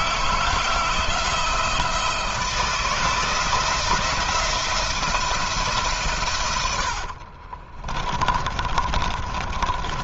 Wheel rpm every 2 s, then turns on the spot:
170, 170, 170, 70, 30.
6-10